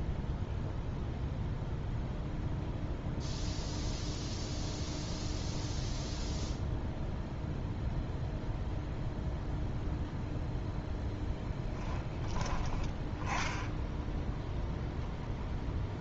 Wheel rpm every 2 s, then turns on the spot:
0, 0, 0, 0, 0, 0, 20, 0.
none